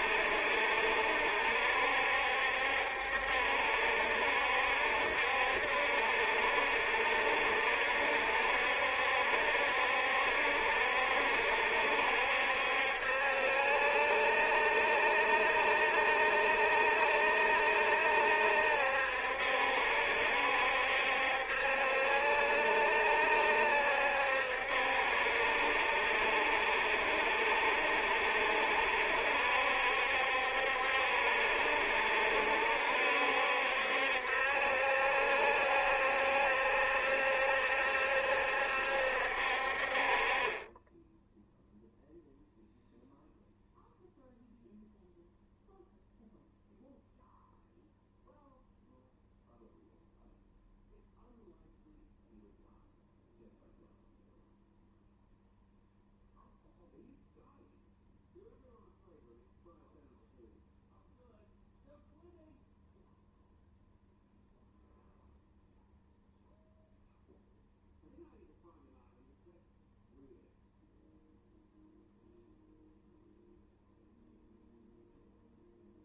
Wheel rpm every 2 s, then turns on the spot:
70, 70, 70, 70, 70, 70, 70, 70, 70, 70, 70, 70, 70, 70, 70, 70, 70, 70, 70, 70, 10, 0, 0, 0, 0, 0, 0, 0, 0, 0, 0, 0, 0, 0, 0, 0, 0, 0.
none